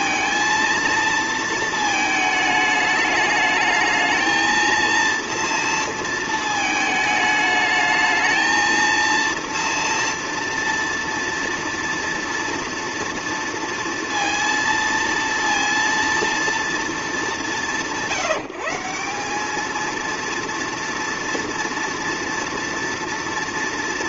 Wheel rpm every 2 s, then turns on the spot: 230, 210, 230, 220, 220, 230, 230, 230, 230, 170, 230, 230.
none